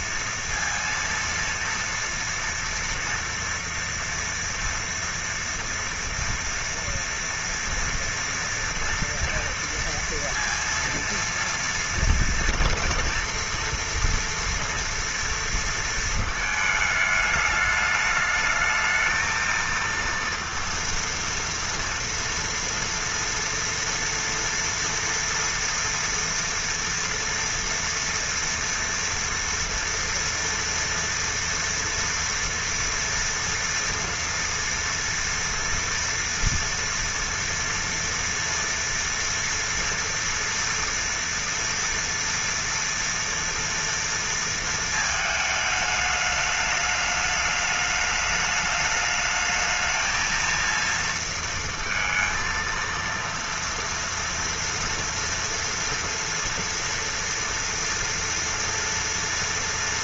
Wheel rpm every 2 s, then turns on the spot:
230, 230, 230, 230, 230, 230, 230, 230, 220, 220, 230, 240, 230, 230, 240, 230, 230, 230, 230, 230, 240, 230, 230, 210, 210, 230, 230, 240, 240, 230.
none